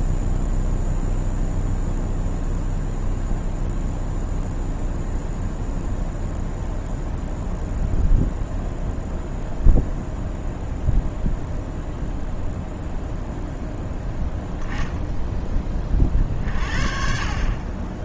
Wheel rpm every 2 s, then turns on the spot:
0, 0, 0, 0, 0, 0, 0, 0, 40.
none